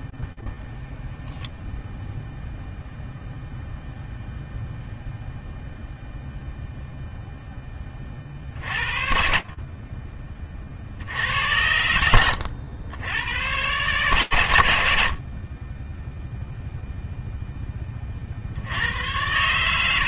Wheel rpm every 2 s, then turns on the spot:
0, 0, 0, 0, 50, 90, 120, 20, 40, 70.
none